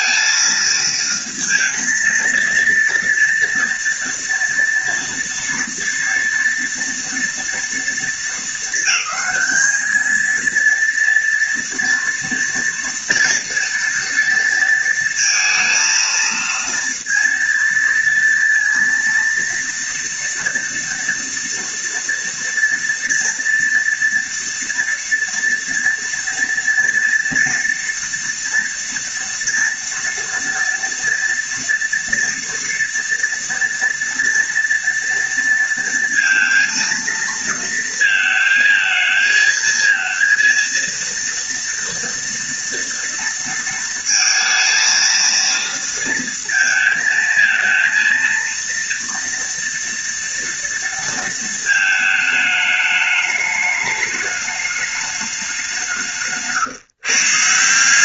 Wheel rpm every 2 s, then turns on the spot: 230, 230, 240, 240, 220, 230, 230, 230, 230, 230, 230, 230, 240, 230, 230, 230, 230, 230, 230, 220, 230, 230, 220, 220, 230, 230, 210, 210, 140.
none